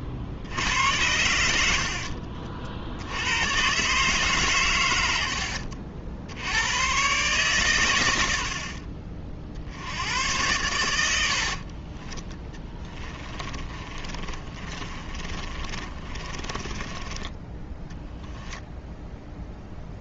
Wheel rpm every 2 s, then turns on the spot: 60, 60, 130, 90, 70, 110, 20, 30, 20, 0.
8-10 12-18